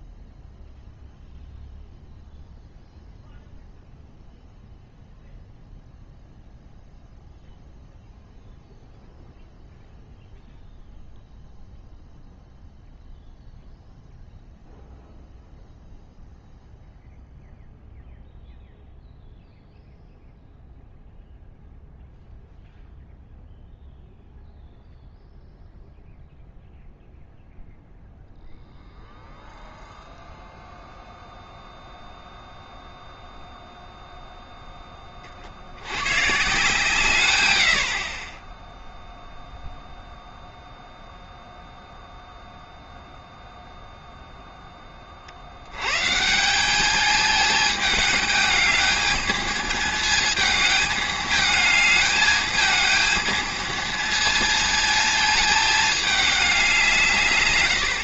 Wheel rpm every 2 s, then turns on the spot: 0, 0, 0, 0, 0, 0, 0, 0, 0, 0, 0, 0, 0, 0, 0, 0, 0, 0, 130, 0, 0, 0, 10, 190, 210, 220, 220, 230, 200.
none